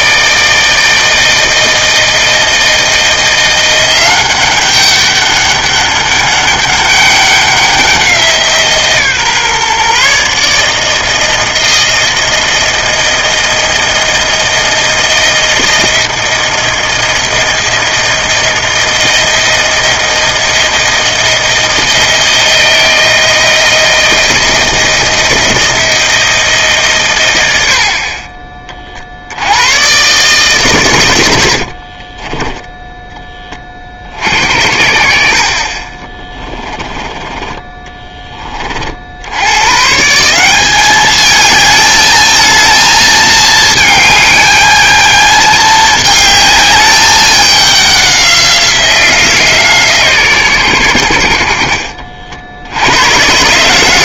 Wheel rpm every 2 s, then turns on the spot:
160, 160, 190, 200, 160, 150, 160, 160, 170, 160, 160, 160, 160, 150, 30, 130, 10, 60, 20, 30, 190, 220, 220, 210, 180, 130, 80.
32-34 36-38